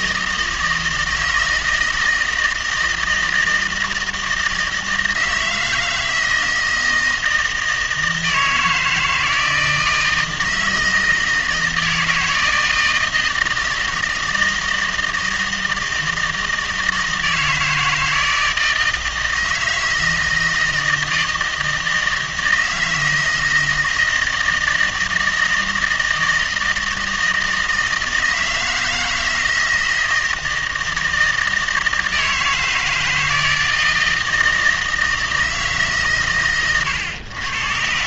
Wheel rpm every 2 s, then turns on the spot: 160, 160, 160, 160, 160, 160, 160, 160, 160, 160, 160, 160, 160, 160, 160, 160, 160, 160, 130.
none